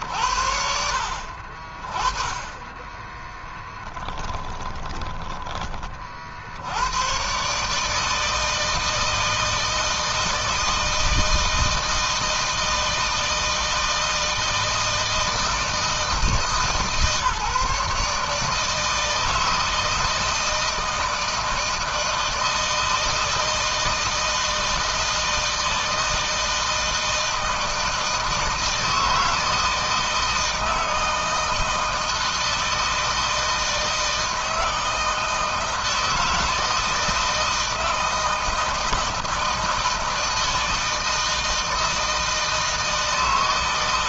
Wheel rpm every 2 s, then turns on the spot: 50, 10, 20, 120, 160, 160, 160, 160, 150, 160, 160, 160, 160, 160, 160, 160, 160, 160, 160, 160, 160, 150.
none